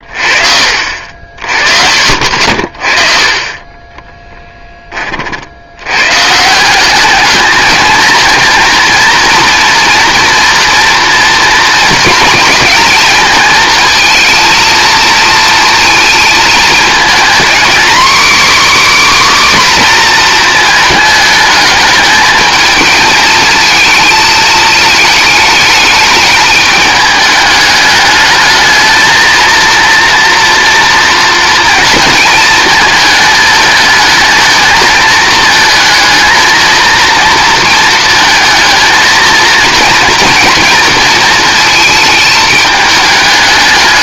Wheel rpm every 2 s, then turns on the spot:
50, 40, 20, 190, 230, 230, 230, 220, 220, 290, 230, 220, 220, 210, 220, 230, 220, 220, 230, 230, 230, 220.
none